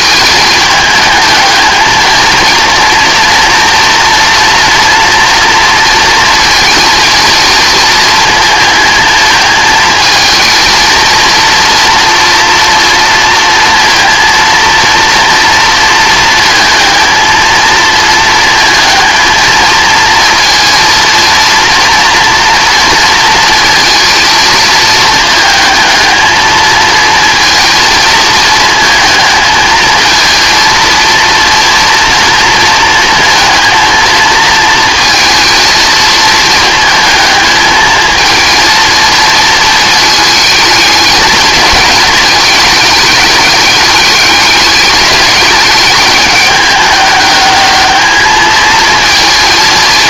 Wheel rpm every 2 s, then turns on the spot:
220, 230, 230, 230, 220, 230, 230, 230, 220, 220, 230, 230, 220, 220, 230, 230, 230, 220, 220, 220, 220, 210, 210, 210, 220.
none